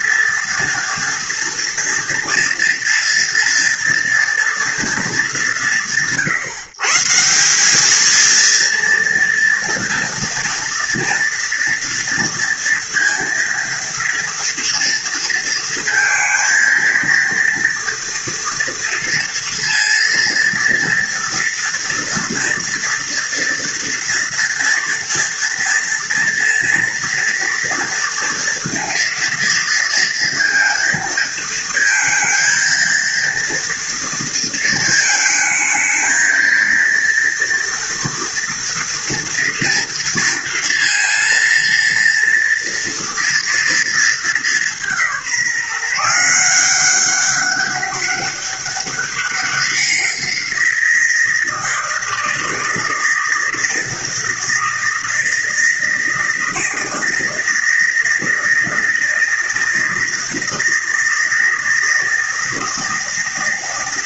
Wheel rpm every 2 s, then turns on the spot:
230, 230, 220, 170, 230, 240, 230, 230, 230, 230, 230, 230, 240, 230, 230, 230, 230, 220, 230, 230, 230, 230, 180, 190, 200, 170, 160, 160, 160, 160, 160, 160.
none